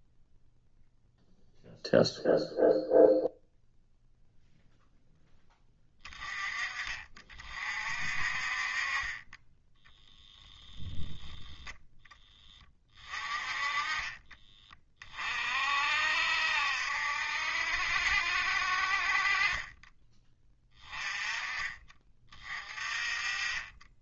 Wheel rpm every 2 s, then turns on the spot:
0, 0, 0, 30, 30, 0, 20, 30, 60, 50, 20, 30.
none